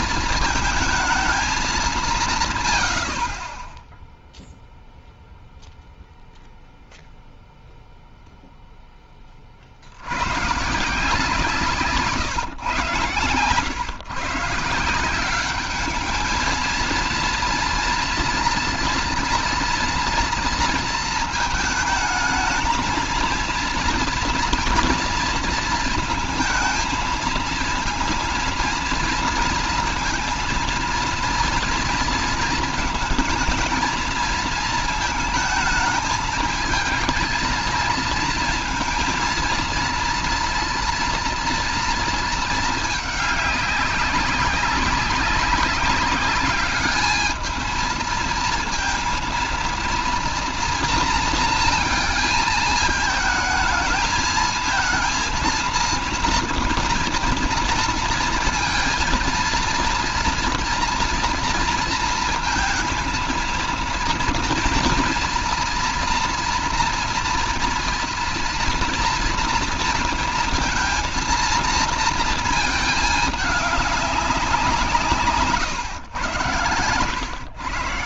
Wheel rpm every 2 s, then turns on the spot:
220, 150, 0, 0, 0, 120, 150, 150, 220, 230, 230, 220, 230, 230, 230, 230, 230, 220, 220, 230, 230, 220, 200, 210, 230, 230, 220, 220, 230, 230, 230, 230, 230, 230, 230, 230, 220, 180, 110.
none